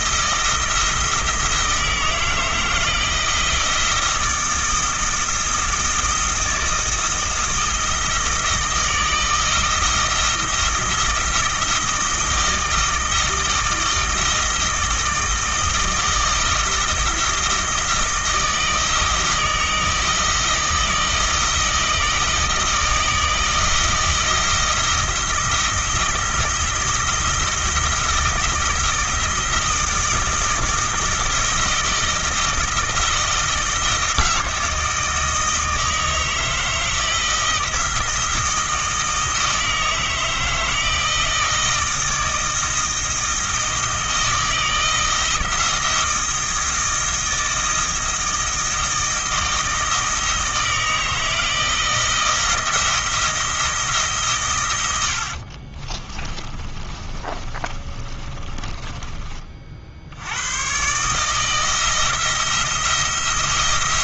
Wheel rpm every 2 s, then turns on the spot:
160, 160, 170, 160, 160, 160, 160, 160, 160, 160, 160, 160, 160, 160, 160, 160, 170, 160, 160, 160, 160, 160, 160, 160, 160, 160, 160, 90, 30, 20, 130, 170.
56-60